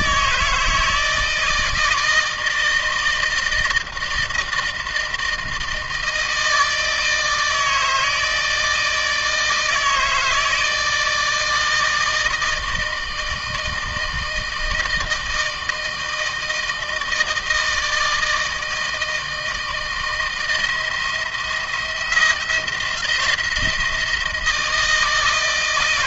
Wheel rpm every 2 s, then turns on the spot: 160, 160, 160, 160, 160, 160, 160, 160, 160, 160, 170, 170, 160.
none